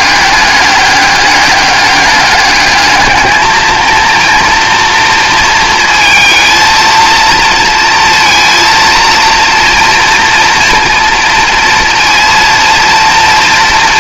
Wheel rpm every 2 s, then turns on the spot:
200, 210, 230, 220, 230, 230, 230.
none